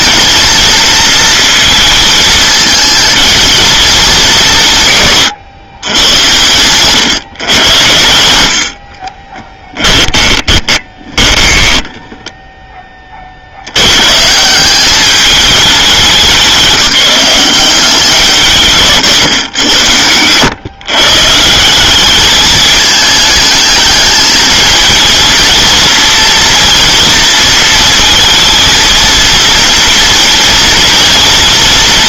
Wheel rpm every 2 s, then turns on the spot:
230, 220, 150, 130, 50, 20, 20, 200, 190, 140, 130, 220, 220, 230, 230, 230.
6-12